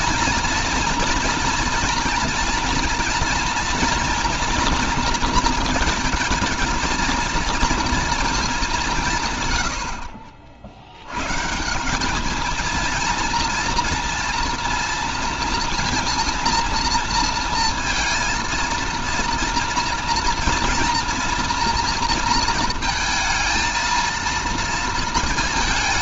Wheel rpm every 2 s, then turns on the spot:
230, 230, 230, 220, 190, 60, 220, 230, 230, 230, 230, 230, 230.
none